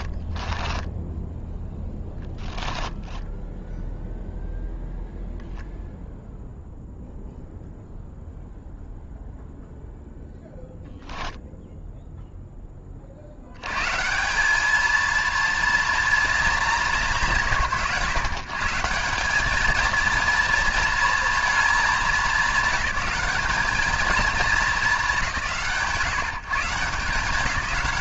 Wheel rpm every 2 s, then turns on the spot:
10, 20, 0, 0, 0, 0, 40, 220, 170, 190, 230, 210, 210, 160.
0-4